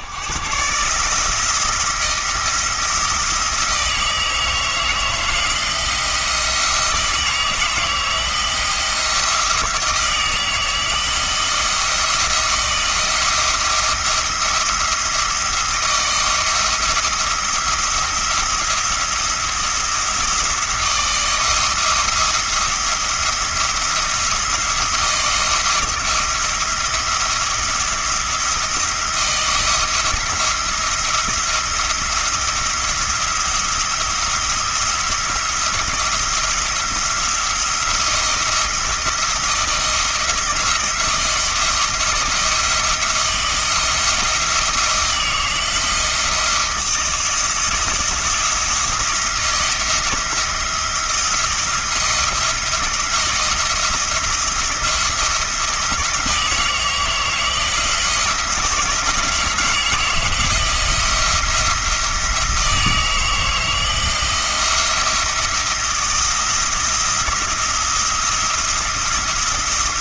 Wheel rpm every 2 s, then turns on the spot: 140, 170, 160, 170, 170, 160, 160, 170, 170, 170, 160, 170, 170, 170, 170, 170, 170, 170, 170, 170, 170, 170, 170, 170, 170, 170, 170, 170, 160, 160, 170, 160, 170, 160, 170.
none